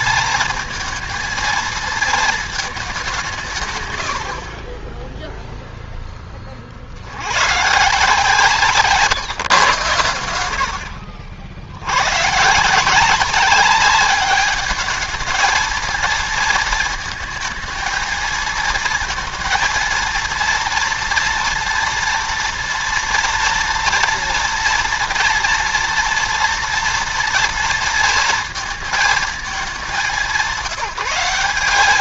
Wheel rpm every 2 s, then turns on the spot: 220, 210, 40, 50, 150, 70, 150, 210, 220, 230, 230, 230, 230, 230, 230, 190.
none